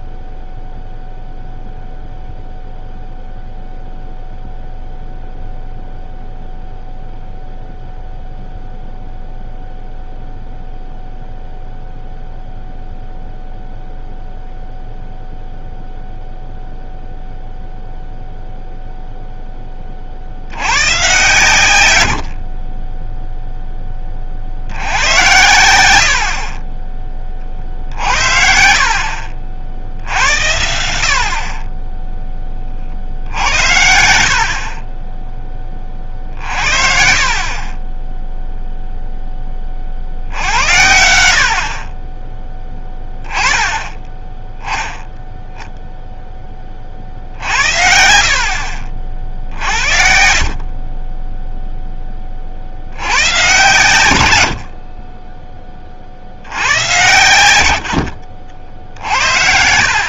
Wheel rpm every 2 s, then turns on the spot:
0, 0, 0, 0, 0, 0, 0, 0, 0, 0, 100, 30, 60, 40, 60, 80, 30, 60, 50, 0, 70, 10, 10, 30, 50, 40, 60, 70, 100, 80.
28-30